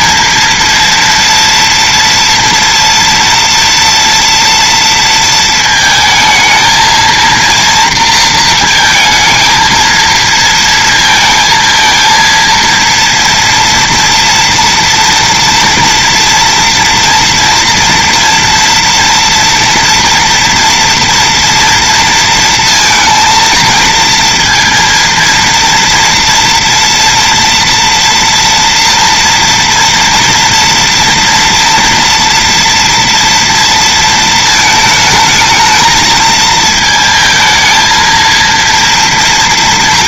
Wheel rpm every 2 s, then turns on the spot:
230, 230, 230, 230, 220, 220, 230, 230, 230, 230, 240, 230, 230, 230, 230, 240, 230, 220, 220, 230.
none